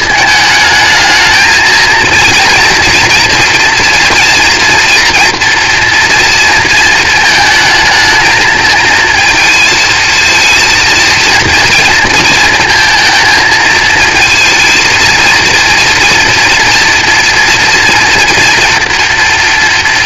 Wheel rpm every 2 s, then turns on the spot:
220, 230, 230, 230, 220, 230, 230, 230, 240, 240.
none